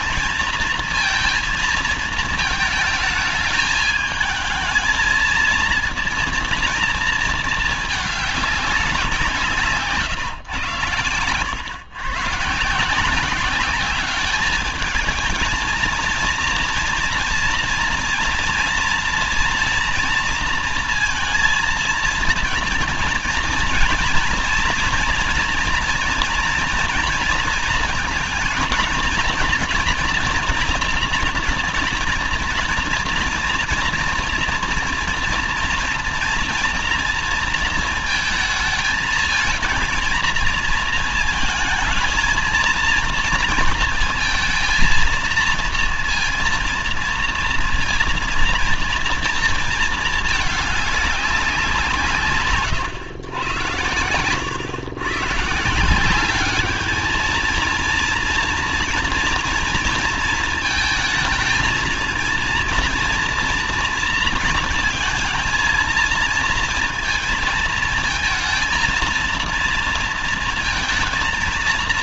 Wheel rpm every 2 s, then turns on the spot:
230, 220, 220, 230, 200, 130, 140, 210, 230, 240, 230, 230, 230, 240, 230, 230, 230, 230, 240, 220, 230, 230, 230, 230, 230, 210, 130, 110, 200, 240, 220, 230, 230, 230, 230, 230.
none